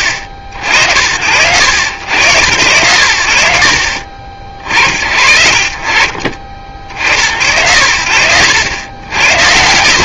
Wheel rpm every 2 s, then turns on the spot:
80, 100, 70, 40, 80.
none